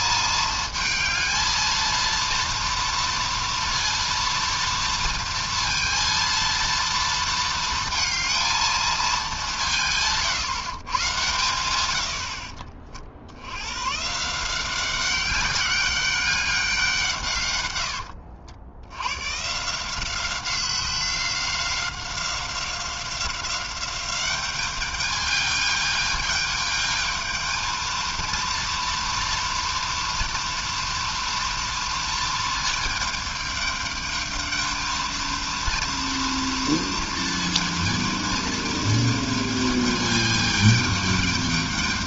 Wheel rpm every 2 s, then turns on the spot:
220, 230, 230, 230, 220, 140, 50, 180, 190, 60, 190, 190, 200, 220, 230, 230, 220, 220, 230, 220, 220.
12-14